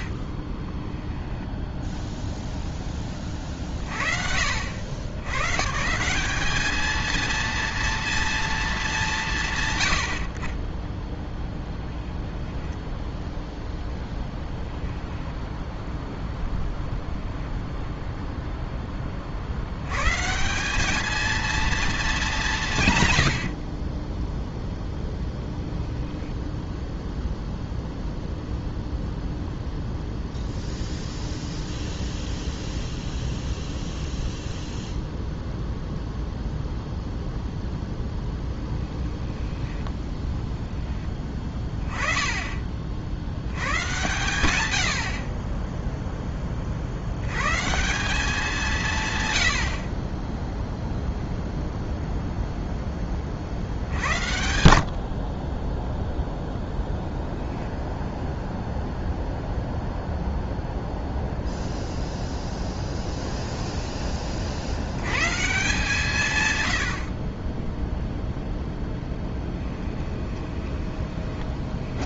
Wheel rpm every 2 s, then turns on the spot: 10, 10, 70, 220, 220, 30, 0, 0, 0, 10, 190, 180, 0, 0, 0, 0, 0, 0, 0, 10, 10, 30, 90, 30, 180, 0, 0, 80, 10, 0, 0, 0, 50, 120, 0, 20.
0-2 38-40 70-72